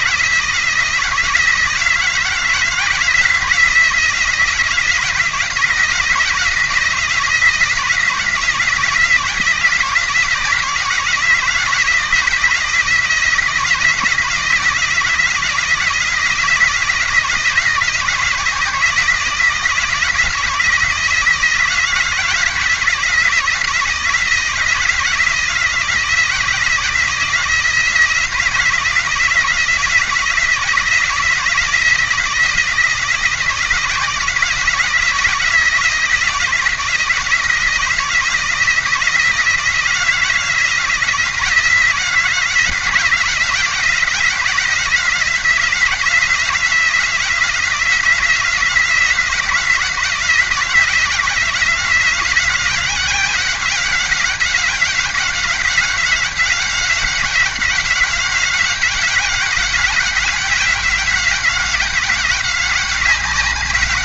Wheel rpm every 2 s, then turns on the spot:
170, 170, 170, 160, 170, 170, 170, 170, 170, 170, 170, 160, 170, 170, 160, 160, 170, 170, 170, 170, 170, 170, 180, 170, 180, 170, 180, 190, 190, 190, 190, 190.
none